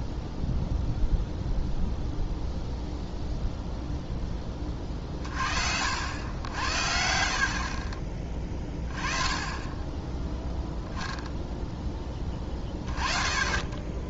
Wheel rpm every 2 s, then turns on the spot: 0, 0, 20, 70, 20, 0, 30.
none